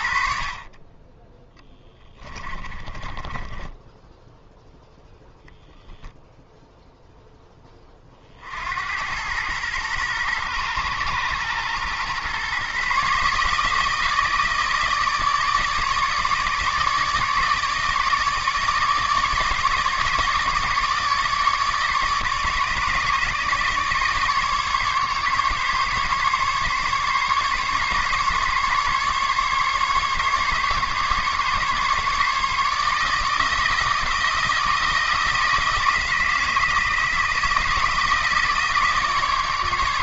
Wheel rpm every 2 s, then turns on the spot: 20, 20, 0, 0, 80, 120, 140, 160, 150, 160, 150, 150, 150, 140, 140, 140, 150, 160, 160, 160.
2-4